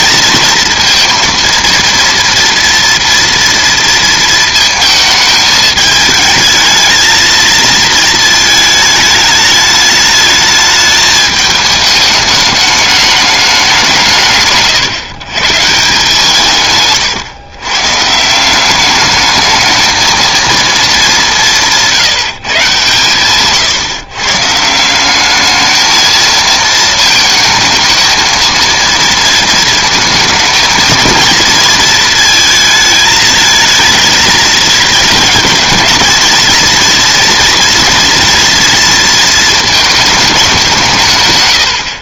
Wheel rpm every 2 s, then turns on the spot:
230, 240, 220, 220, 220, 210, 210, 150, 140, 190, 230, 150, 150, 220, 230, 220, 220, 230, 230, 230, 190.
none